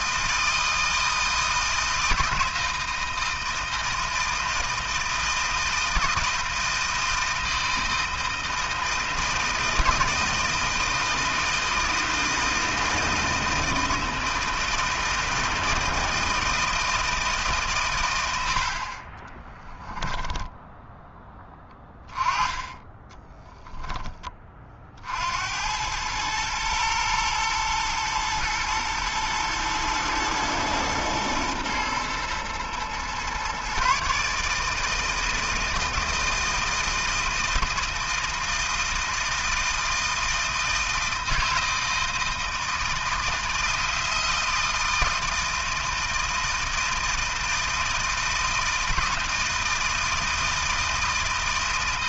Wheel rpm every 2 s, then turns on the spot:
160, 160, 160, 160, 160, 160, 160, 160, 160, 70, 10, 10, 30, 110, 110, 110, 120, 150, 160, 160, 160, 160, 160, 160, 160, 160.
18-22